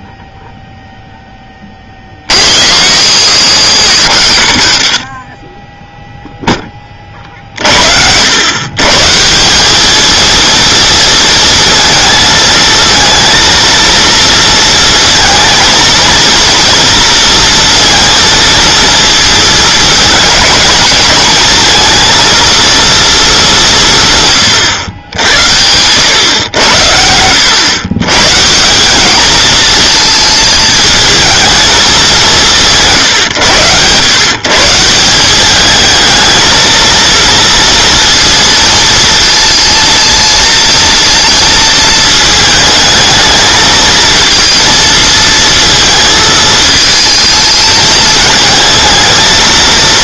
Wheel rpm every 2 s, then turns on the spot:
0, 60, 70, 10, 120, 230, 230, 230, 230, 230, 220, 230, 110, 90, 160, 220, 160, 150, 220, 230, 230, 220, 230, 220, 220.
none